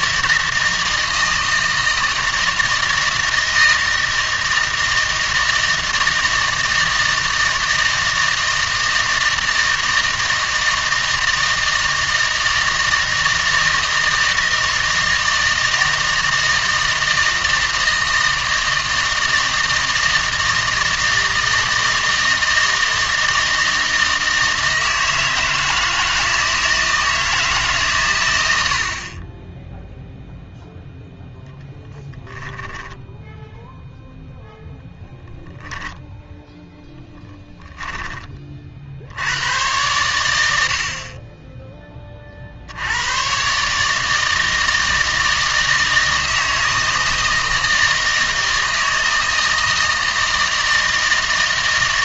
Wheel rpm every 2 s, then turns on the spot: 160, 160, 160, 160, 160, 160, 160, 160, 160, 160, 160, 160, 160, 160, 80, 0, 10, 0, 0, 50, 80, 60, 160, 160, 160, 160.
32-34